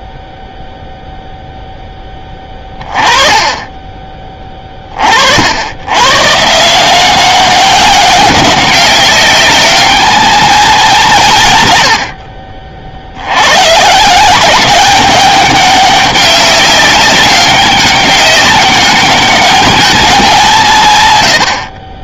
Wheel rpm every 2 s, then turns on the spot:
0, 20, 30, 160, 200, 220, 50, 200, 200, 200, 160.
none